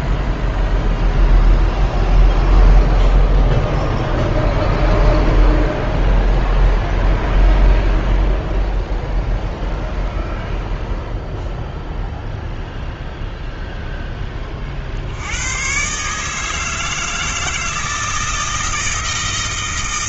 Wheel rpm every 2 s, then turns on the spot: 0, 0, 0, 0, 0, 0, 0, 40, 160, 160.
none